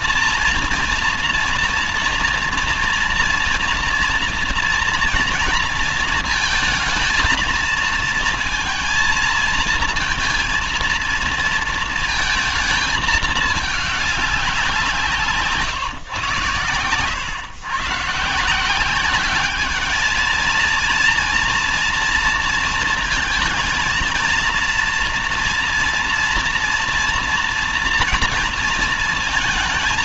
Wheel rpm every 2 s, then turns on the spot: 230, 230, 230, 230, 230, 230, 220, 180, 110, 170, 220, 230, 230, 230, 230.
none